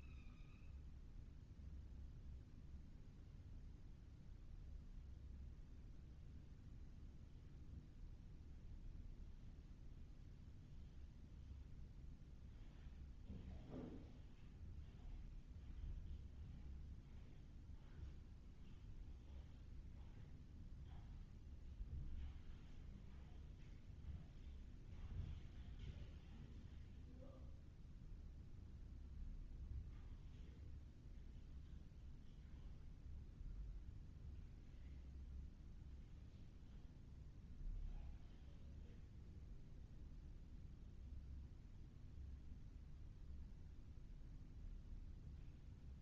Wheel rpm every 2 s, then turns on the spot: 0, 0, 0, 0, 0, 0, 0, 0, 0, 0, 0, 0, 0, 0, 0, 0, 0, 0, 0, 0, 0, 0, 0.
none